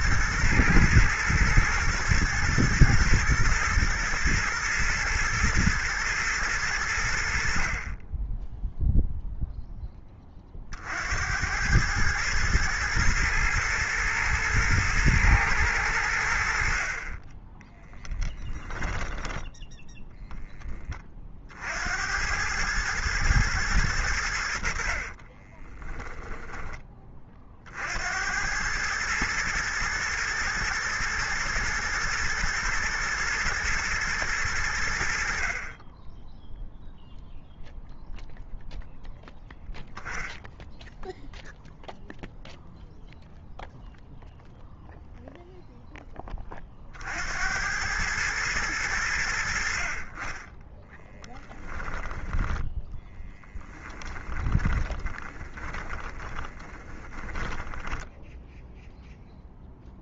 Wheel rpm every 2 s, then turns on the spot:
120, 110, 110, 90, 0, 50, 110, 120, 40, 10, 20, 110, 50, 20, 110, 120, 120, 80, 0, 0, 0, 0, 0, 40, 100, 10, 10, 30, 10, 0.
52-58